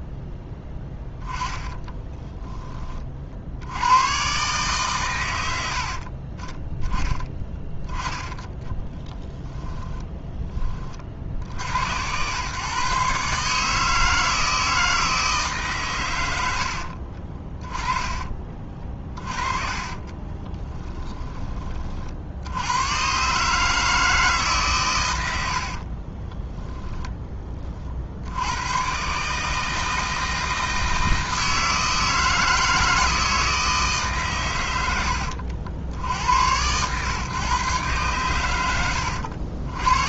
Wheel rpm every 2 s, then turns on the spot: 10, 10, 130, 20, 40, 20, 130, 160, 70, 30, 20, 90, 140, 10, 110, 160, 160, 110, 110, 100.
0-2 8-10 16-22 26-28